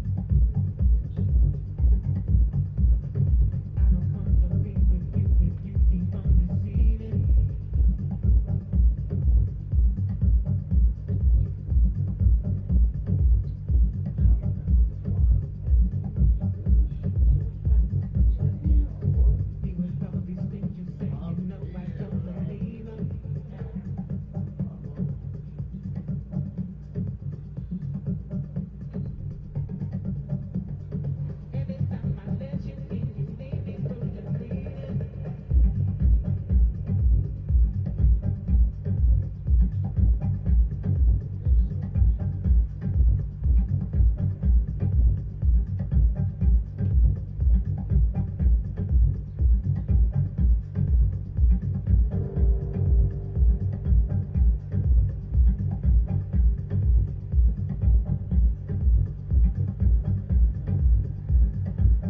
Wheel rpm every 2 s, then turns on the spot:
0, 0, 0, 0, 0, 0, 0, 0, 0, 0, 0, 0, 0, 0, 0, 0, 0, 0, 0, 0, 0, 0, 0, 0, 0, 0, 0, 0, 0, 0, 0.
none